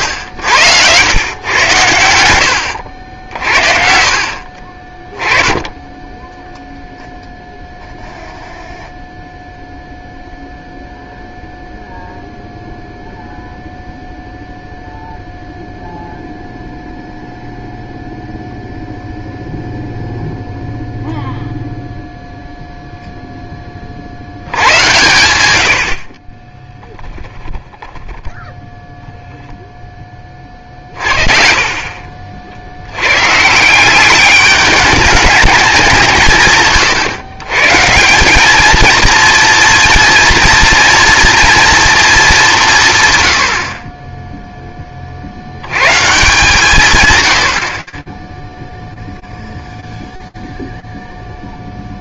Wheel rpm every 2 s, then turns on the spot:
90, 80, 40, 0, 0, 0, 0, 0, 0, 0, 0, 0, 100, 10, 0, 40, 80, 210, 130, 220, 230, 170, 10, 170, 0, 0.
26-28